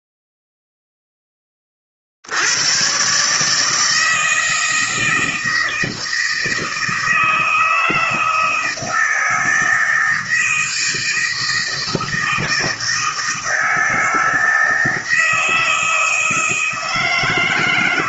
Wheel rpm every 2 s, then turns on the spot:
0, 90, 160, 160, 160, 160, 160, 160, 160.
none